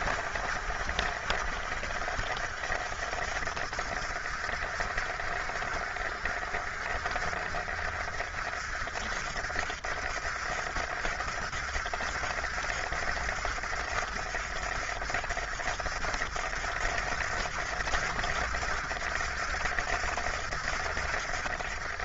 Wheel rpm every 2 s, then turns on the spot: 60, 60, 60, 50, 60, 60, 60, 60, 60, 60, 60.
none